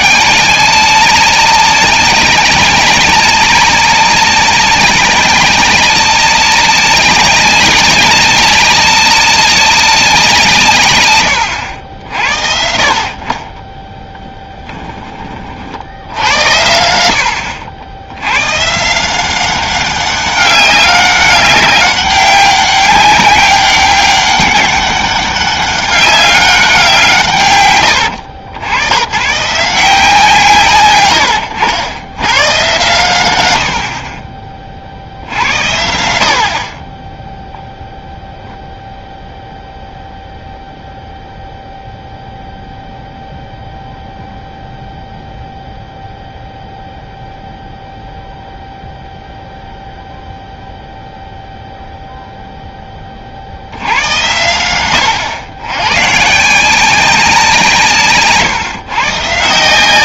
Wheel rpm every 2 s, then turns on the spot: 190, 190, 200, 200, 200, 130, 60, 10, 80, 140, 200, 190, 200, 190, 90, 140, 120, 50, 20, 0, 0, 0, 0, 0, 0, 0, 20, 100, 170, 140.
none